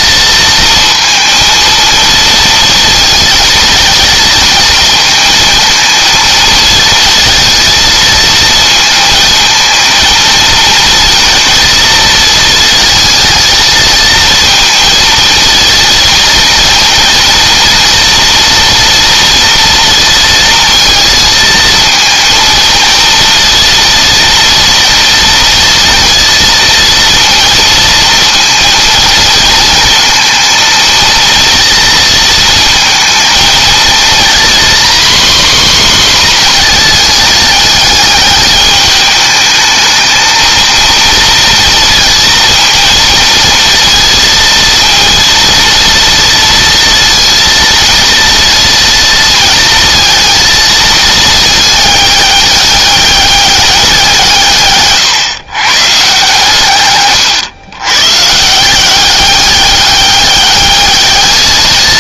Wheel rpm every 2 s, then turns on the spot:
230, 230, 230, 220, 220, 220, 220, 230, 230, 230, 230, 230, 230, 230, 230, 230, 220, 240, 240, 210, 230, 230, 230, 230, 230, 220, 200, 140, 140, 170, 210.
none